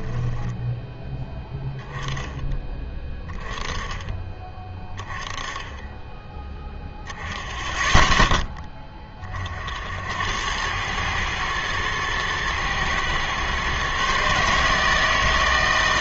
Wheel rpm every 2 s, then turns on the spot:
10, 10, 20, 10, 10, 100, 110, 150.
0-2